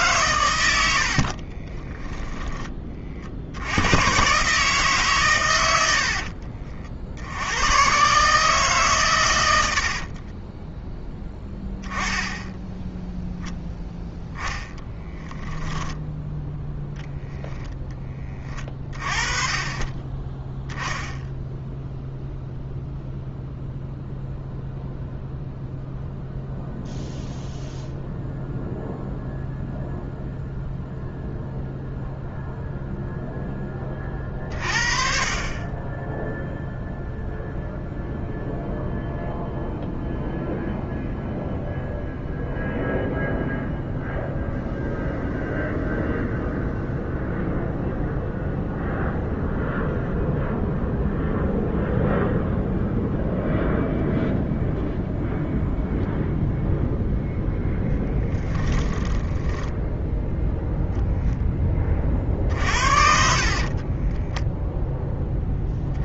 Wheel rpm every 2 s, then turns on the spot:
60, 30, 140, 60, 130, 10, 0, 20, 0, 30, 0, 0, 0, 0, 0, 0, 0, 40, 0, 0, 0, 0, 0, 0, 0, 0, 0, 0, 0, 10, 0, 60, 10.
0-2 58-60 62-64